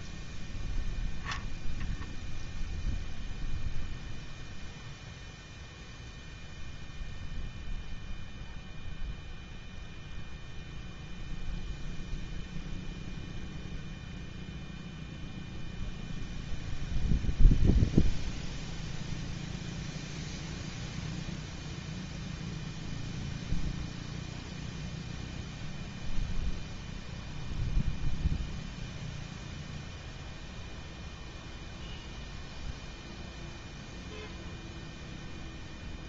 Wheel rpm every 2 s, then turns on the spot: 10, 0, 0, 0, 0, 0, 0, 0, 0, 0, 0, 0, 0, 0, 0, 0, 0, 0.
0-2